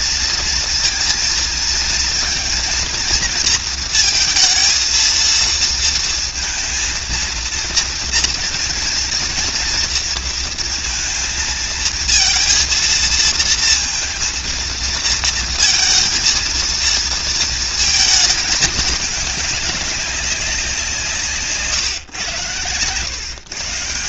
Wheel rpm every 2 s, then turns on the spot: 230, 230, 220, 230, 230, 230, 230, 230, 230, 220, 190, 120.
none